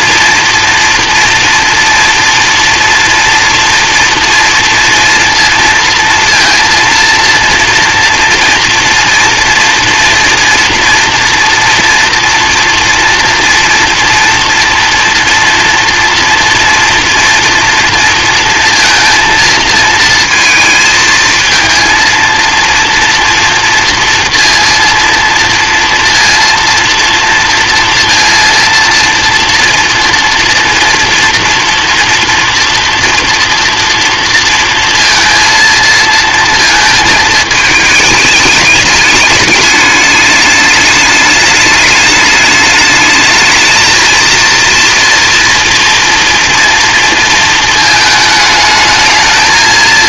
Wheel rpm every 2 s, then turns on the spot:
230, 230, 230, 230, 230, 240, 240, 230, 230, 230, 220, 230, 230, 230, 230, 230, 240, 230, 230, 210, 210, 210, 230, 230, 220.
none